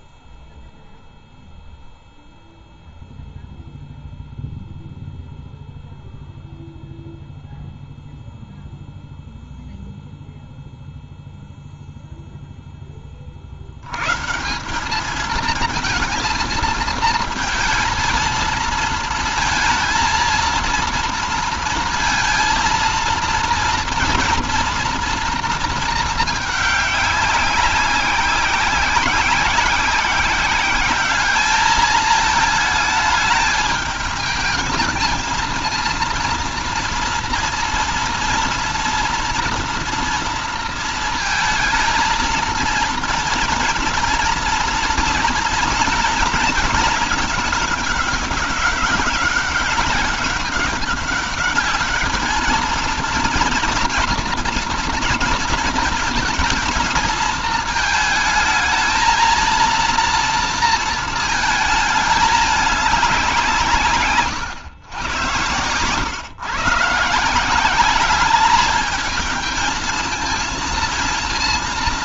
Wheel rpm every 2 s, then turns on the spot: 0, 0, 0, 0, 0, 0, 0, 170, 230, 230, 230, 230, 230, 210, 190, 190, 220, 220, 230, 230, 230, 220, 230, 220, 190, 200, 220, 230, 230, 220, 230, 210, 120, 140, 210, 230.
none